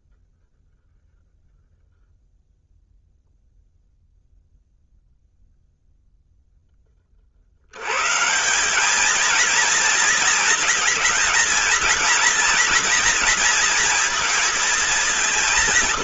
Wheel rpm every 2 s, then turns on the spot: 0, 0, 0, 20, 200, 220, 240, 220.
none